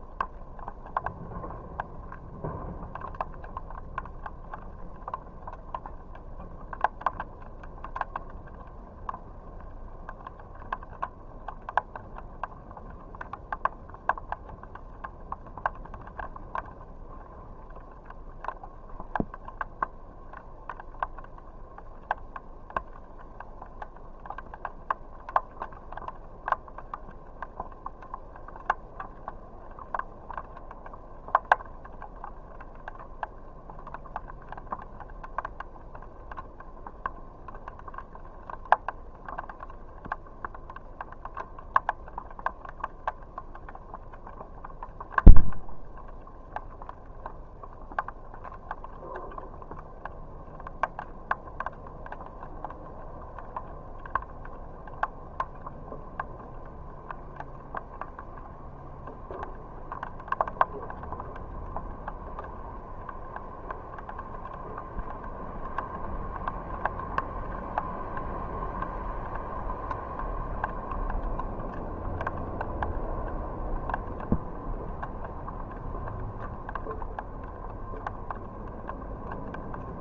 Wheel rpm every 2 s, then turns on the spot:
0, 0, 0, 0, 0, 0, 0, 0, 0, 0, 0, 0, 0, 0, 0, 0, 0, 0, 0, 0, 0, 0, 0, 0, 0, 0, 0, 0, 0, 0, 0, 0, 0, 0, 0, 0, 0, 0, 0, 0.
none